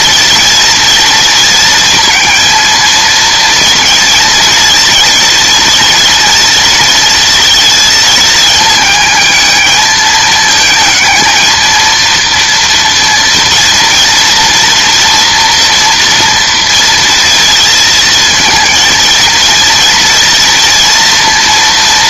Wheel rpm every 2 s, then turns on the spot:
230, 230, 230, 230, 220, 220, 230, 230, 230, 230, 230.
none